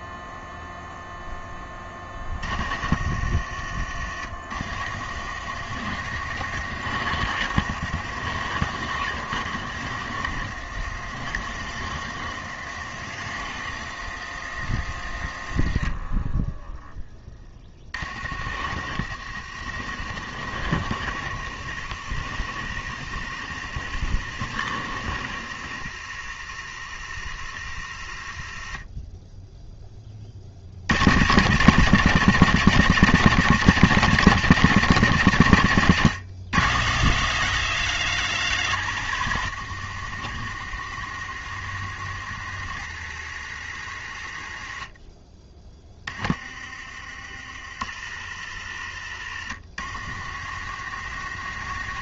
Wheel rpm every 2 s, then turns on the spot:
0, 30, 50, 70, 70, 70, 70, 60, 10, 60, 70, 70, 70, 60, 30, 70, 190, 180, 160, 160, 70, 60, 40, 30, 50, 60.
none